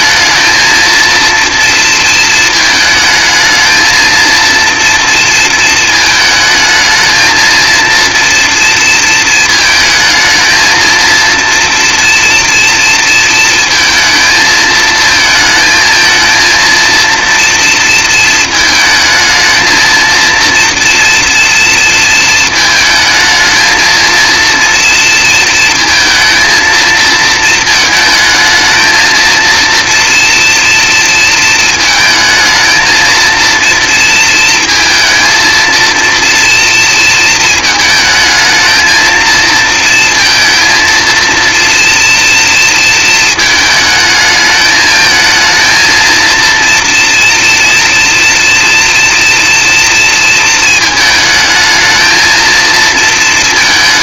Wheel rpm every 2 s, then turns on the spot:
230, 220, 230, 220, 230, 230, 230, 220, 230, 220, 230, 220, 230, 230, 220, 230, 220, 230, 230, 220, 230, 230, 220, 230, 240, 220, 230.
none